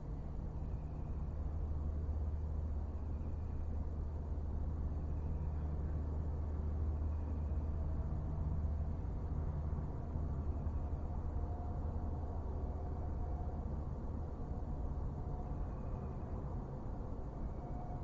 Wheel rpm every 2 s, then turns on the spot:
0, 0, 0, 0, 0, 0, 0, 0, 0.
none